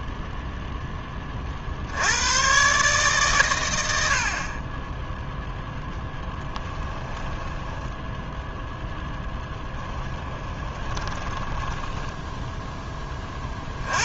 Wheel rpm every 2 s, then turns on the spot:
10, 130, 20, 10, 0, 20, 10.
6-8 10-12